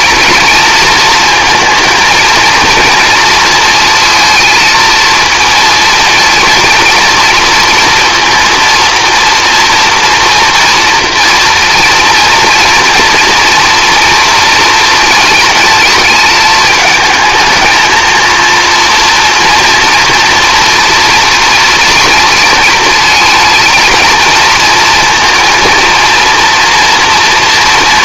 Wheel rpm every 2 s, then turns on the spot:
230, 230, 220, 230, 230, 240, 230, 230, 220, 230, 230, 230, 230, 240.
none